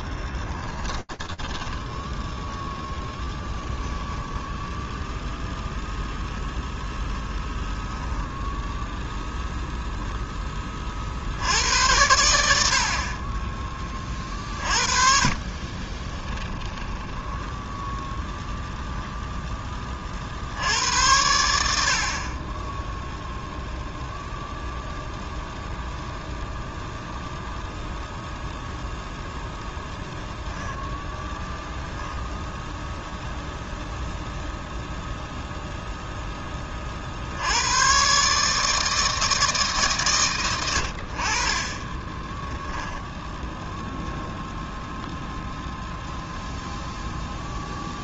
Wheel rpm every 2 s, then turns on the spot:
10, 20, 0, 10, 10, 60, 30, 40, 10, 10, 90, 0, 0, 0, 0, 0, 0, 0, 70, 160, 60, 10, 10, 0.
0-4 14-18 42-44